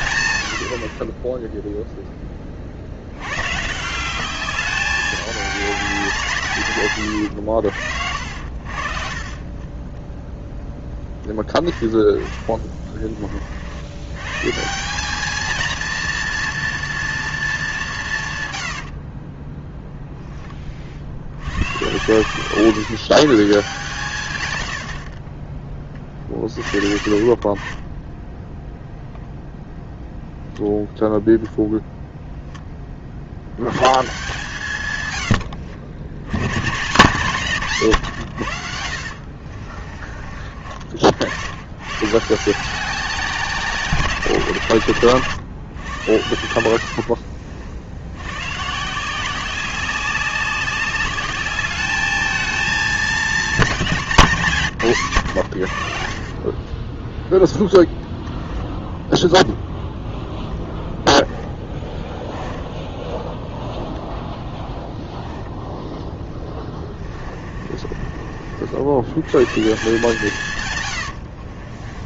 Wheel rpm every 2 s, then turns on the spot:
60, 60, 200, 130, 60, 10, 20, 170, 230, 80, 40, 150, 80, 40, 0, 0, 20, 140, 140, 70, 50, 190, 130, 80, 130, 190, 210, 150, 20, 10, 10, 10, 0, 20, 80, 120.
18-20 56-58 60-62 66-68